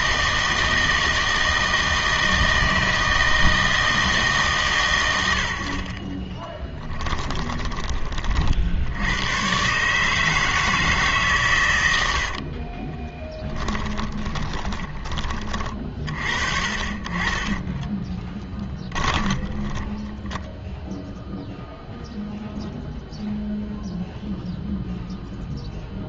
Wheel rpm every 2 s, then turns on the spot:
160, 160, 130, 10, 60, 160, 50, 20, 40, 10, 0, 0, 0.
6-8 12-16 18-20